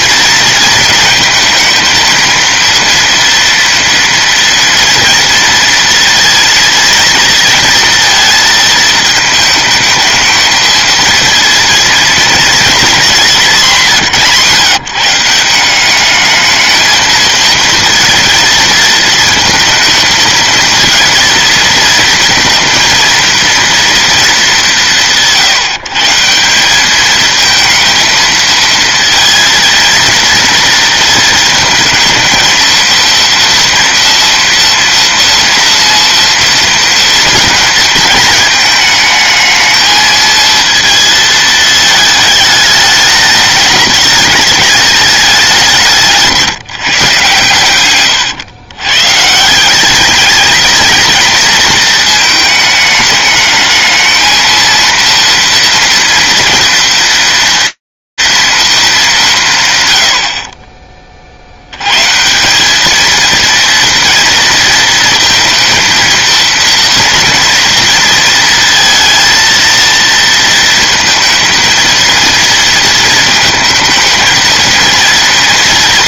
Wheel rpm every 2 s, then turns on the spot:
220, 230, 230, 240, 220, 220, 220, 160, 220, 220, 230, 230, 190, 190, 230, 230, 230, 230, 230, 220, 230, 210, 200, 150, 120, 230, 220, 230, 230, 190, 40, 220, 220, 230, 230, 230, 230, 230.
none